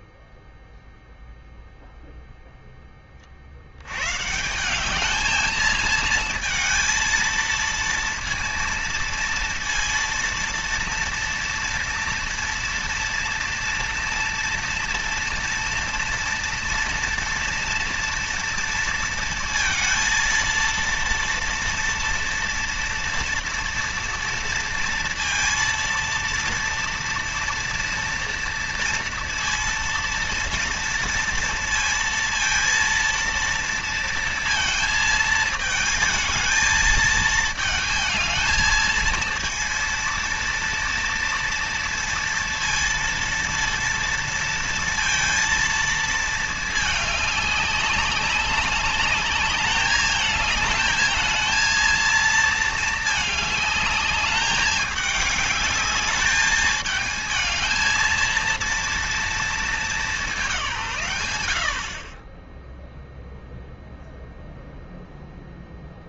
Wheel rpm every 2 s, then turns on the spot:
0, 0, 160, 220, 230, 230, 230, 230, 230, 230, 230, 230, 230, 230, 230, 230, 230, 230, 220, 220, 230, 230, 230, 220, 200, 220, 220, 210, 210, 230, 180, 10, 0.
none